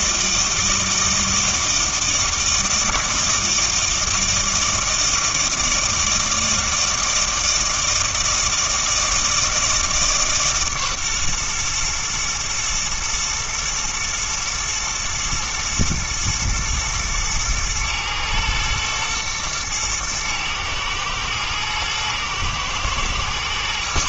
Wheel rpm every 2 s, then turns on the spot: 160, 160, 160, 160, 160, 140, 120, 120, 110, 110, 110, 120.
none